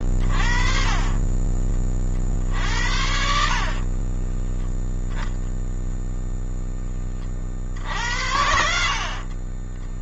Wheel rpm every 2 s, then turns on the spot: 30, 50, 30, 0, 80.
4-6 8-10